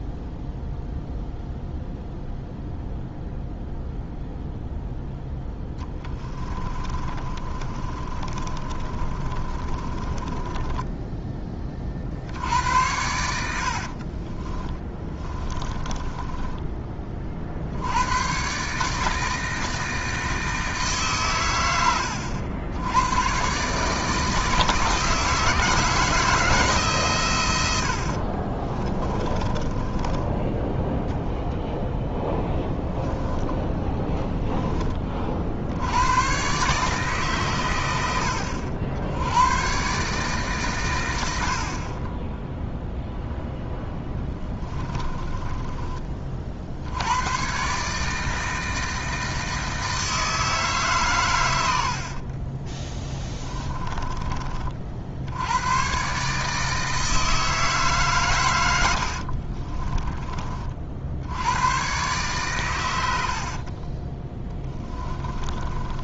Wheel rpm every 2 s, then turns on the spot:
0, 0, 0, 20, 30, 10, 90, 20, 20, 150, 150, 100, 160, 150, 30, 10, 10, 10, 140, 80, 130, 0, 20, 70, 160, 150, 20, 50, 160, 80, 50, 110, 20.
6-12 14-16 28-30 44-46 52-54 64-66